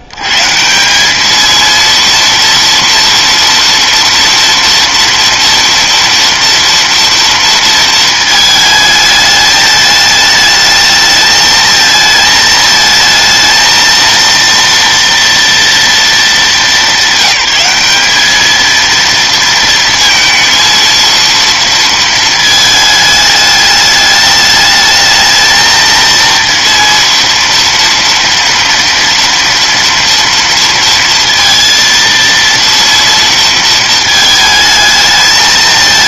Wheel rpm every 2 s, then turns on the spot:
80, 230, 230, 230, 220, 220, 220, 230, 210, 220, 230, 220, 210, 230, 230, 230, 230, 220.
none